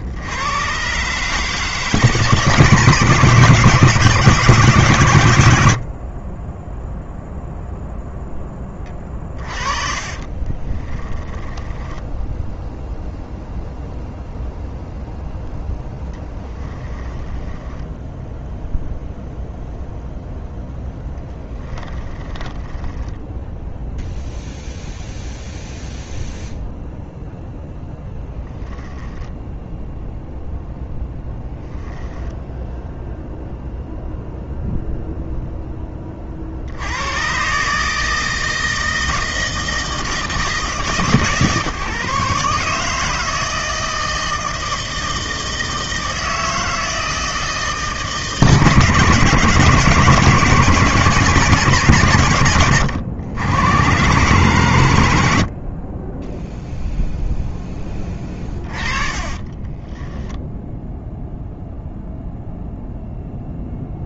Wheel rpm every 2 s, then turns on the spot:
150, 170, 90, 0, 30, 10, 0, 0, 10, 0, 10, 0, 0, 0, 0, 0, 0, 0, 140, 160, 150, 160, 160, 160, 170, 160, 100, 80, 0, 30, 0, 0.
8-12 20-22 58-60